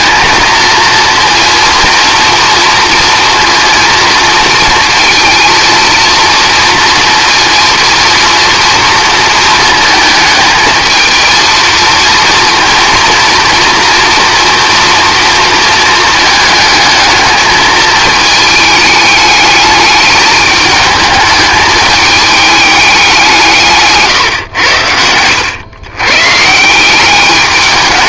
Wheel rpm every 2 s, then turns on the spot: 230, 230, 230, 230, 230, 220, 230, 230, 220, 210, 220, 210, 90, 160.
none